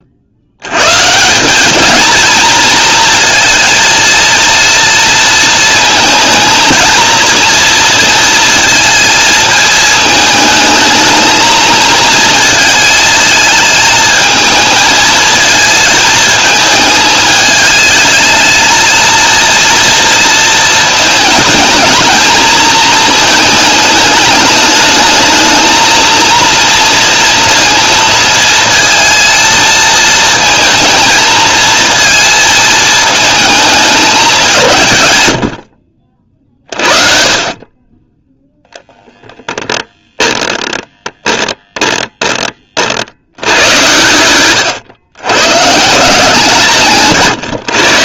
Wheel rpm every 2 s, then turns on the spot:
100, 230, 230, 230, 230, 220, 220, 220, 220, 220, 220, 220, 220, 230, 230, 230, 220, 150, 50, 0, 10, 30, 110, 170.
none